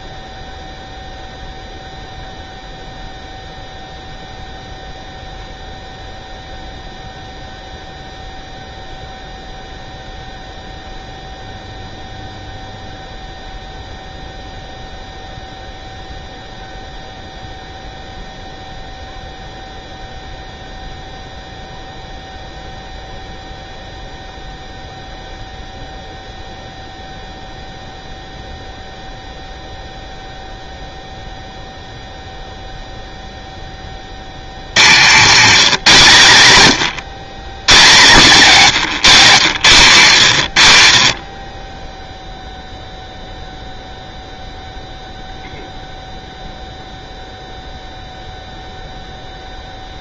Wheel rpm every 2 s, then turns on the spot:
0, 0, 0, 0, 0, 0, 0, 0, 0, 0, 0, 0, 0, 0, 0, 0, 0, 90, 140, 170, 110, 0, 0, 0, 0.
none